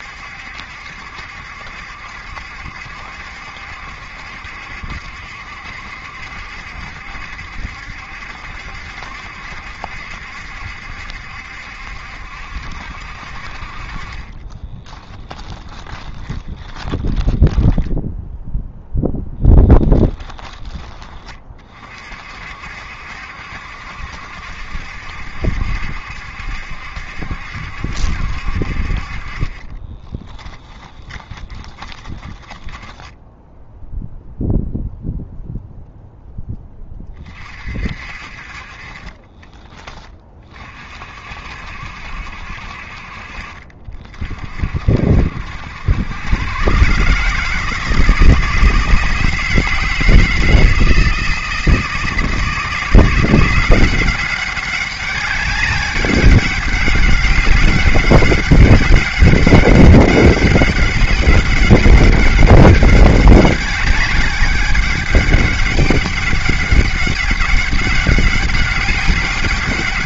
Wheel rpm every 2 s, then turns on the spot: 70, 70, 70, 70, 70, 70, 60, 10, 20, 0, 20, 60, 70, 70, 50, 20, 20, 0, 20, 40, 40, 50, 60, 140, 160, 160, 170, 200, 200, 200, 200, 200, 200, 190, 200.
14-18 30-34